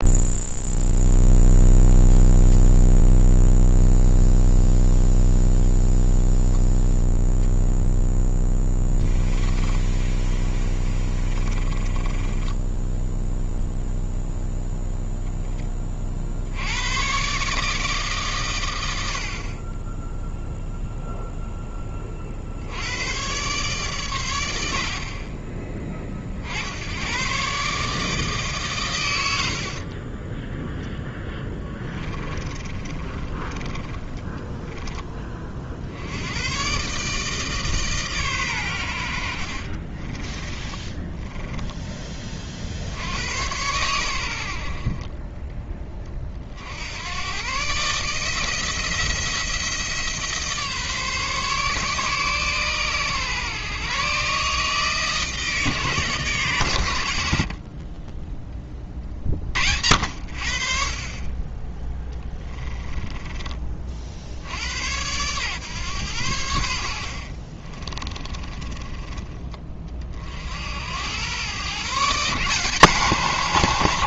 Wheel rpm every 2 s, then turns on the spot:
0, 0, 0, 0, 10, 30, 10, 10, 110, 80, 0, 90, 50, 90, 130, 0, 30, 10, 130, 90, 20, 60, 40, 80, 170, 150, 130, 150, 130, 30, 50, 10, 90, 70, 20, 90, 160.
8-14 32-34 40-42 62-64 68-70